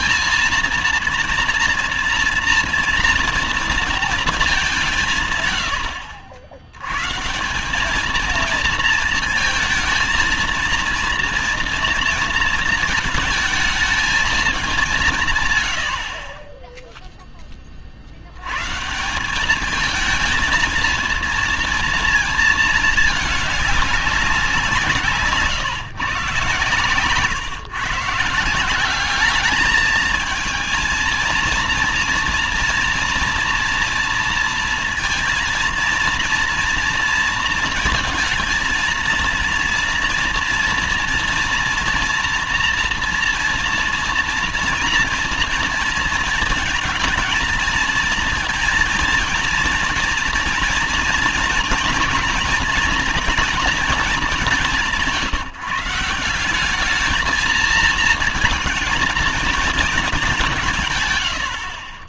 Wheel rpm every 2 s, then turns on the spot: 230, 230, 190, 90, 230, 230, 230, 190, 10, 140, 230, 220, 180, 130, 180, 220, 230, 230, 230, 220, 230, 230, 230, 220, 220, 240, 240, 190, 200, 230, 160.
none